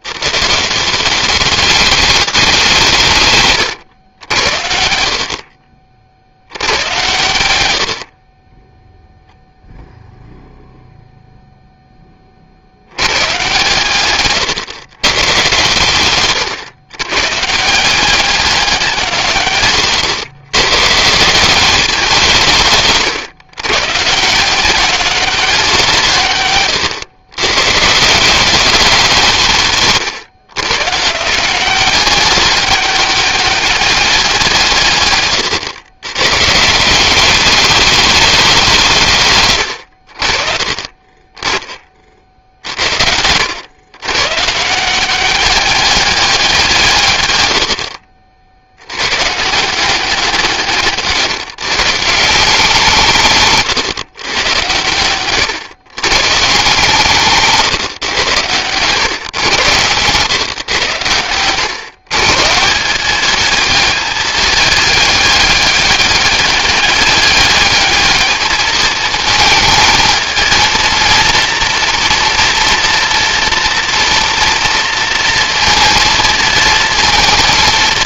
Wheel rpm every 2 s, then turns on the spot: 150, 200, 70, 90, 10, 0, 50, 130, 120, 190, 130, 160, 170, 130, 190, 130, 200, 170, 140, 200, 40, 60, 150, 180, 60, 170, 170, 110, 140, 120, 130, 160, 210, 200, 220, 230, 240, 230, 230.
14-16